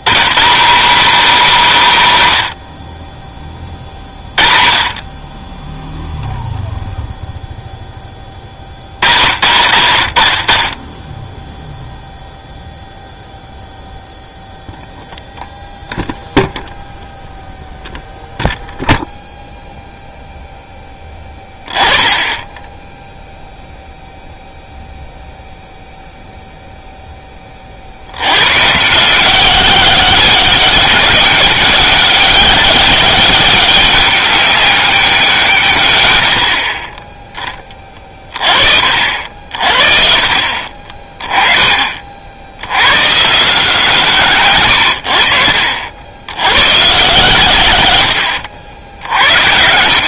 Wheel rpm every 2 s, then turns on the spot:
200, 80, 40, 0, 70, 40, 0, 0, 0, 0, 10, 10, 0, 0, 140, 190, 200, 200, 50, 40, 40, 90, 120, 110, 80.
none